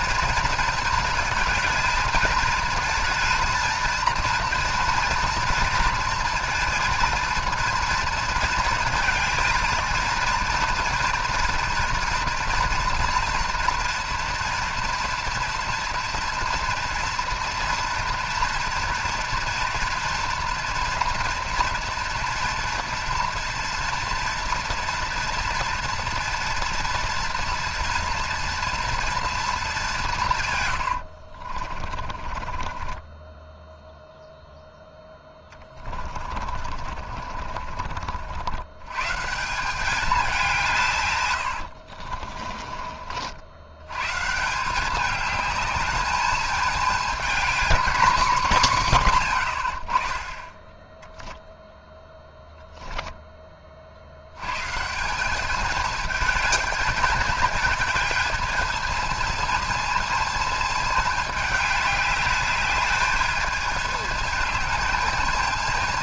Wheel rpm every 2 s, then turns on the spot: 230, 230, 230, 230, 230, 230, 230, 230, 230, 230, 230, 230, 230, 230, 230, 120, 30, 10, 40, 110, 180, 30, 180, 220, 170, 10, 0, 140, 220, 220, 220, 210, 220.
30-38 42-44